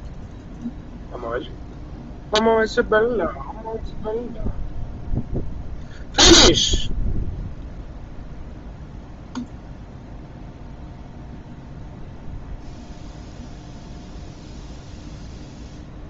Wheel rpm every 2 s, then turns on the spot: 0, 0, 0, 0, 0, 0, 0, 0.
none